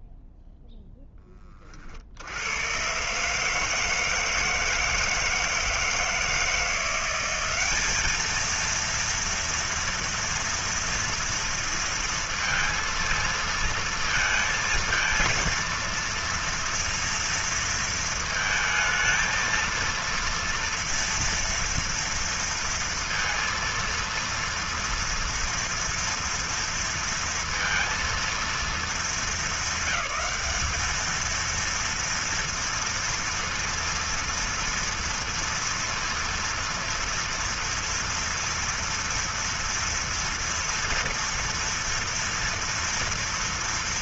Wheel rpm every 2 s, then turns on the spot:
0, 100, 160, 170, 220, 230, 230, 220, 230, 230, 230, 230, 230, 230, 230, 220, 230, 230, 230, 230, 230, 230.
none